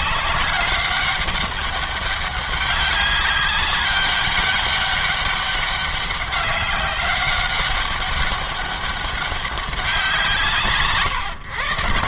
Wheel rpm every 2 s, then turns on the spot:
190, 200, 200, 200, 200, 150.
none